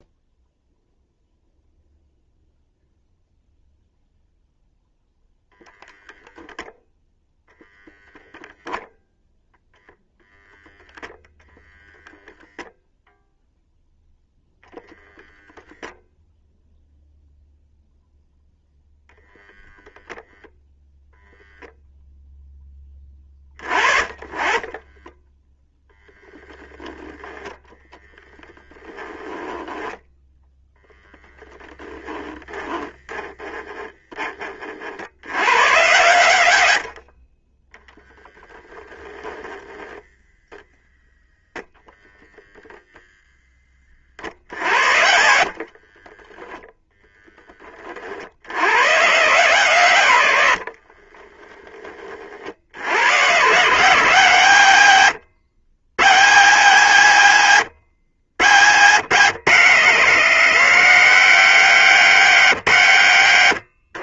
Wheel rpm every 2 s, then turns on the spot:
0, 0, 0, 0, 0, 0, 0, 10, 0, 0, 0, 10, 20, 0, 10, 0, 10, 60, 50, 0, 0, 0, 70, 0, 110, 50, 80, 110, 120, 130, 170, 110.
24-26 28-30 44-46 50-52